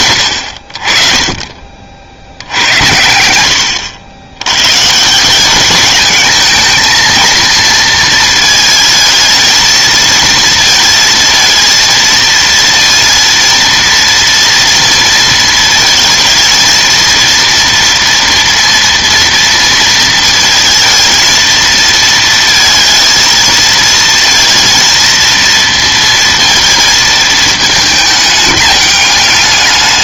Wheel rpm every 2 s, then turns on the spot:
60, 70, 110, 220, 230, 220, 230, 230, 220, 240, 220, 220, 230, 230, 210.
none